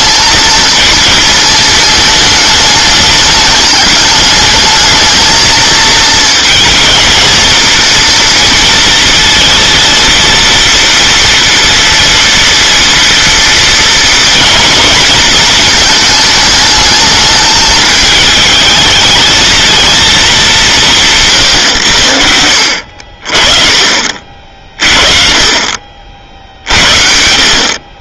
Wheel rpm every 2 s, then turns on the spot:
230, 210, 210, 220, 230, 230, 230, 240, 220, 220, 170, 70, 40, 60.
none